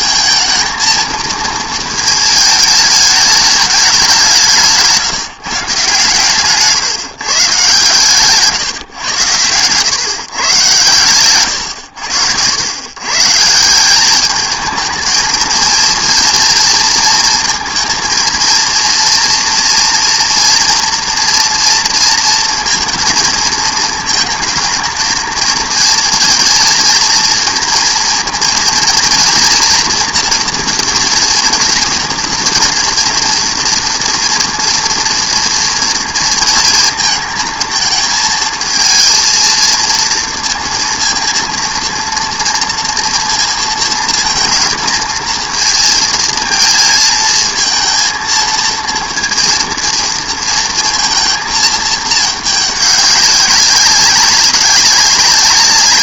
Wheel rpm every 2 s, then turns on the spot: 230, 220, 160, 150, 140, 120, 100, 220, 230, 230, 230, 230, 220, 230, 230, 230, 230, 230, 230, 230, 230, 230, 230, 220, 230, 230, 200, 200.
none